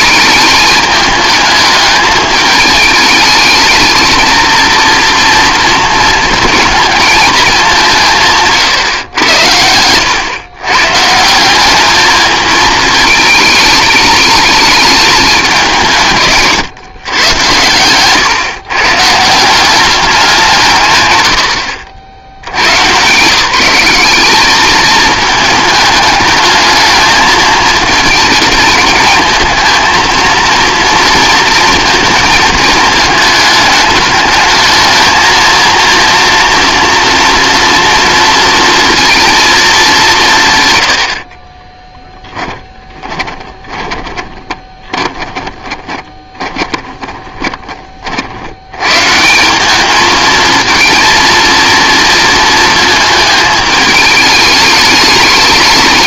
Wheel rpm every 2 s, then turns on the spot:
220, 220, 230, 230, 140, 130, 220, 210, 140, 130, 160, 110, 210, 220, 220, 230, 220, 220, 240, 230, 130, 20, 20, 20, 90, 220, 220, 210.
42-48